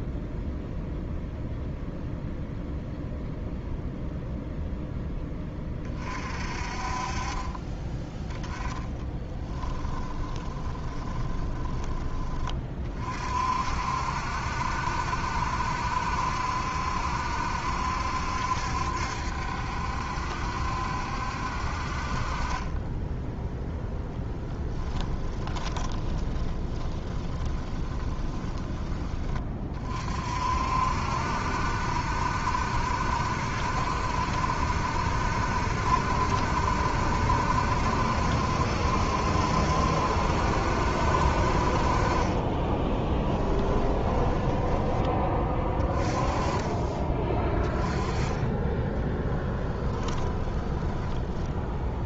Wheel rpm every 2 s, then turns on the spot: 0, 0, 0, 40, 20, 10, 30, 70, 70, 70, 70, 20, 10, 20, 20, 60, 70, 70, 70, 70, 70, 30, 10, 20, 10, 20.
8-12 24-28 42-44 50-52